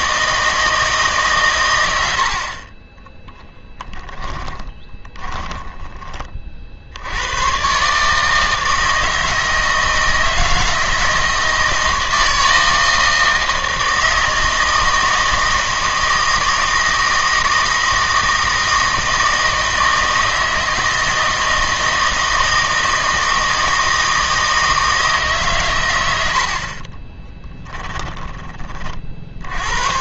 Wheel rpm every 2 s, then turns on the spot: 160, 40, 20, 60, 160, 160, 160, 160, 160, 160, 160, 160, 160, 50, 20.
4-6